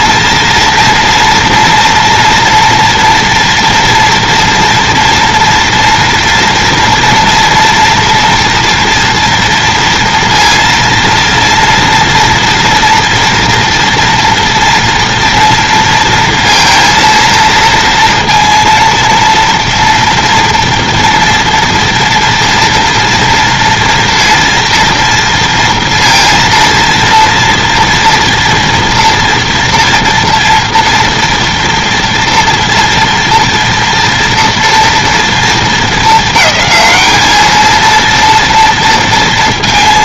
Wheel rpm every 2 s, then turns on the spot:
230, 230, 240, 230, 230, 230, 240, 230, 230, 230, 230, 230, 230, 230, 240, 230, 230, 230, 220, 230.
none